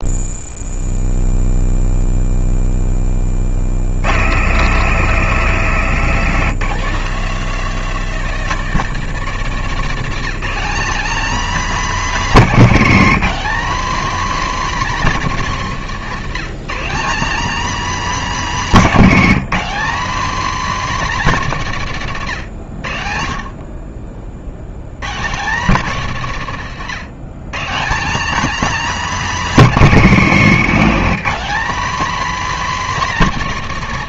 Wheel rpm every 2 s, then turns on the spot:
0, 0, 110, 160, 190, 240, 250, 260, 200, 250, 270, 80, 120, 150, 270, 210, 260.
none